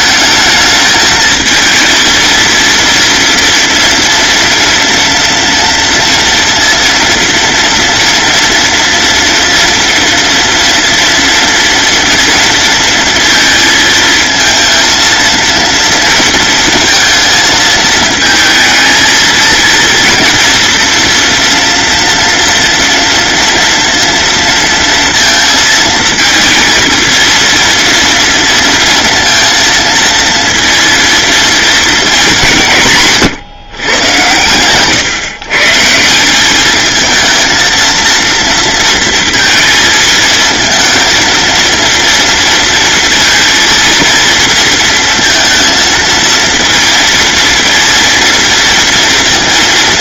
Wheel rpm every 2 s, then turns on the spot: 220, 230, 230, 230, 230, 230, 230, 230, 230, 230, 240, 230, 230, 230, 230, 230, 180, 120, 210, 230, 230, 230, 230, 230, 230.
none